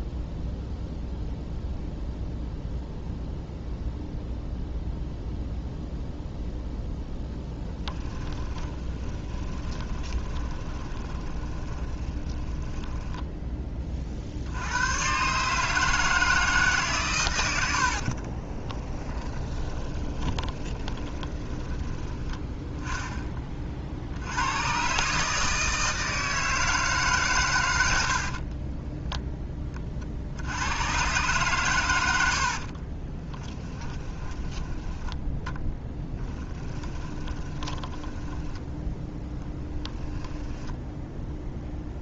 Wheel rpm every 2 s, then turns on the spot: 0, 0, 0, 0, 40, 20, 10, 100, 130, 20, 20, 10, 120, 150, 20, 120, 40, 10, 10, 10, 0.
8-14 18-22 28-30 32-34 36-38